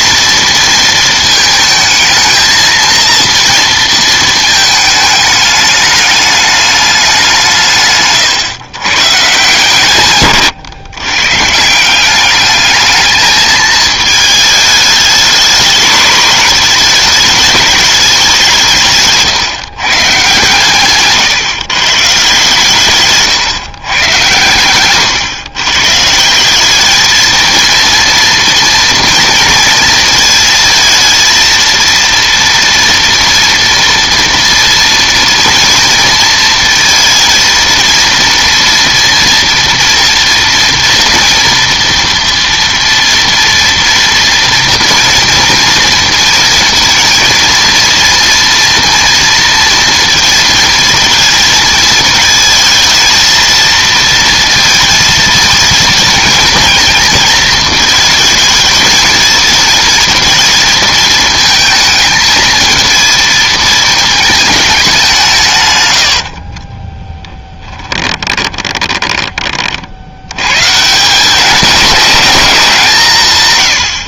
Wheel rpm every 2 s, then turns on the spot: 230, 230, 220, 210, 130, 120, 210, 210, 210, 180, 140, 140, 120, 200, 230, 230, 230, 230, 230, 240, 230, 230, 230, 230, 240, 230, 230, 230, 220, 220, 220, 220, 210, 40, 20, 120, 200.
66-70